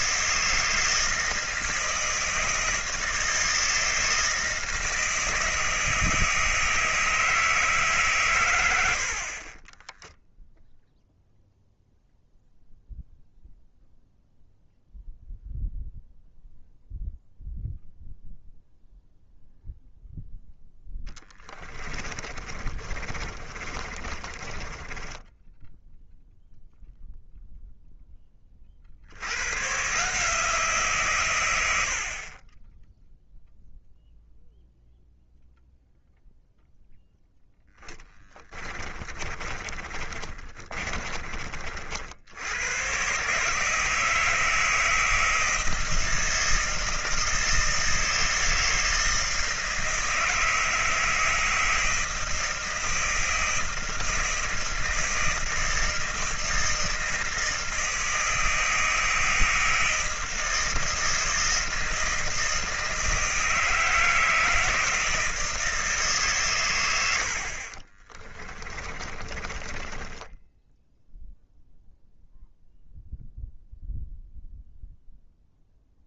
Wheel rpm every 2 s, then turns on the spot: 160, 160, 160, 160, 100, 0, 0, 0, 0, 0, 0, 30, 20, 0, 40, 160, 20, 0, 0, 20, 40, 90, 160, 160, 160, 160, 160, 160, 160, 160, 160, 160, 160, 120, 20, 10, 0, 0.
22-26 38-42 68-72